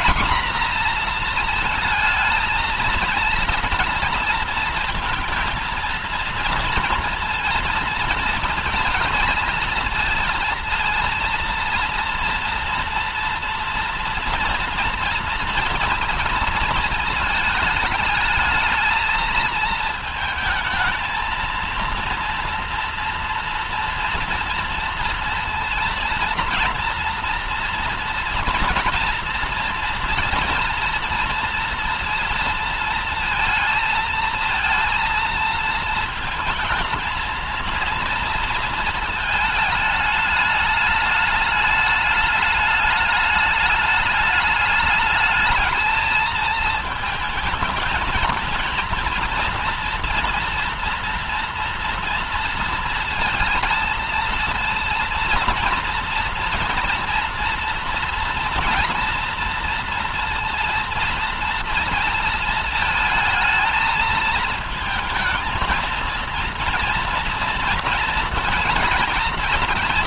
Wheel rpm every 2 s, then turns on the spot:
240, 230, 230, 230, 230, 230, 230, 240, 230, 220, 220, 230, 230, 230, 230, 230, 230, 230, 230, 230, 210, 210, 210, 220, 230, 240, 230, 230, 230, 230, 230, 220, 220, 230, 230.
none